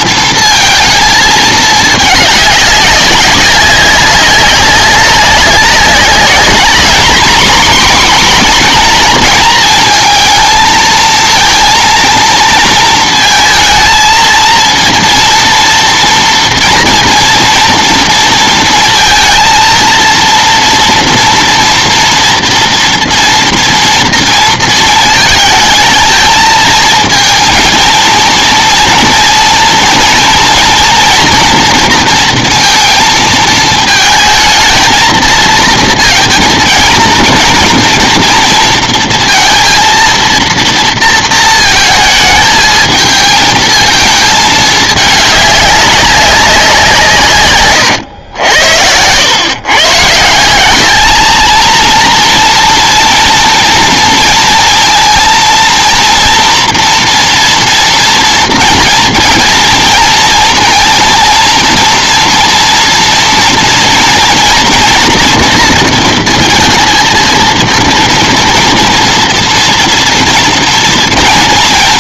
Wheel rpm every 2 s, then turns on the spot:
230, 200, 190, 230, 230, 220, 230, 230, 230, 230, 230, 230, 220, 220, 230, 230, 230, 220, 230, 230, 230, 220, 210, 170, 90, 190, 230, 230, 230, 240, 230, 230, 240, 230, 230, 230.
none